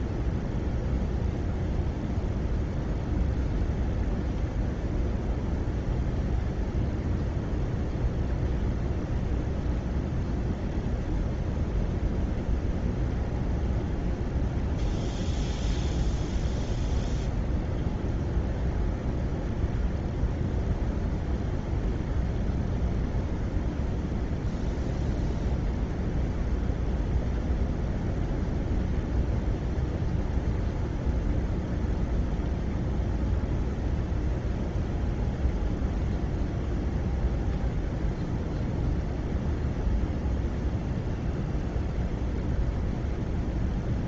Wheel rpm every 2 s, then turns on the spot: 0, 0, 0, 0, 0, 0, 0, 0, 0, 0, 0, 0, 0, 0, 0, 0, 0, 0, 0, 0, 0, 0.
none